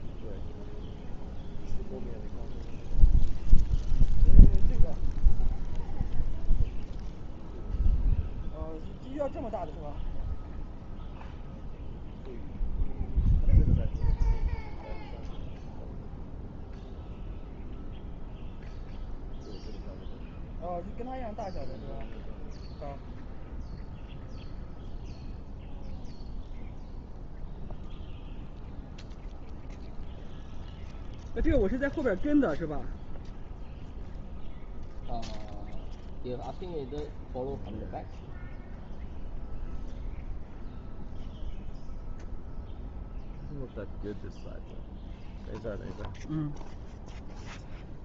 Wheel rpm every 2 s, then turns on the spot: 0, 0, 0, 0, 0, 0, 0, 0, 0, 0, 0, 0, 0, 0, 0, 0, 0, 0, 0, 0, 0, 0, 0, 0.
none